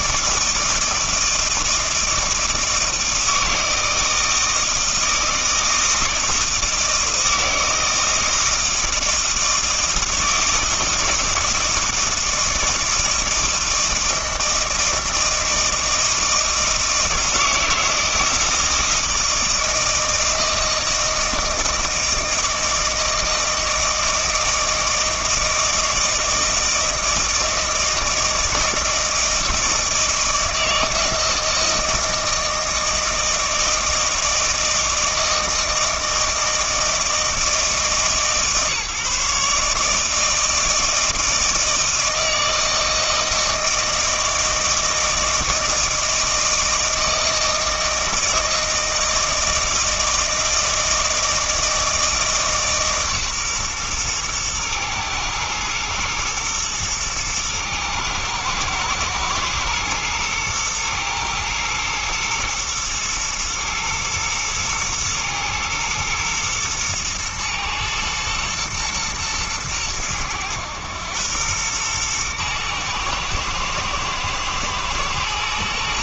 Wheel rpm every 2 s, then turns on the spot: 160, 160, 160, 160, 160, 160, 160, 160, 160, 160, 160, 160, 160, 160, 160, 160, 160, 160, 160, 140, 160, 160, 160, 160, 160, 160, 150, 120, 110, 110, 110, 120, 110, 110, 110, 110, 110, 110.
none